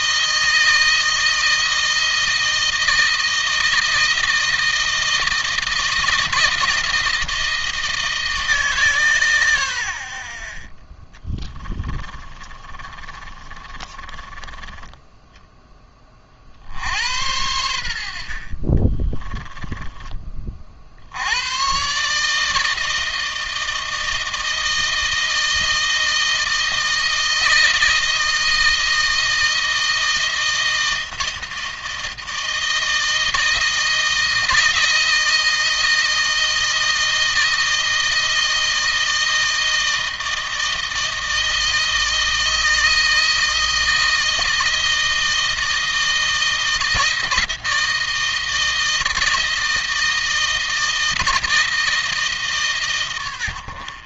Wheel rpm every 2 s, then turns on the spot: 160, 160, 160, 160, 150, 40, 30, 10, 50, 40, 30, 150, 160, 160, 160, 160, 160, 160, 160, 160, 160, 160, 160, 160, 160, 160, 150.
12-14 18-20